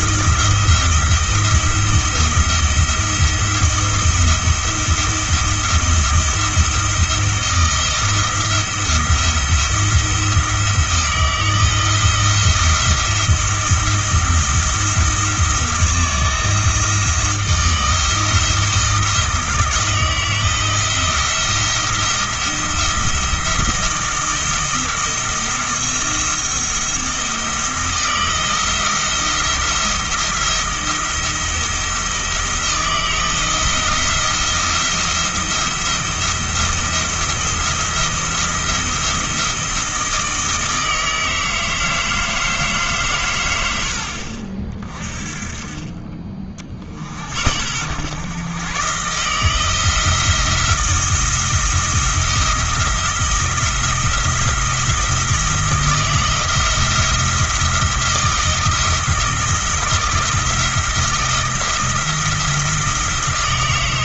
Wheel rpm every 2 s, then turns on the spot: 170, 170, 170, 170, 170, 160, 170, 170, 170, 170, 170, 170, 170, 170, 170, 170, 160, 170, 170, 170, 160, 150, 40, 50, 130, 170, 170, 170, 160, 160, 170, 170.
none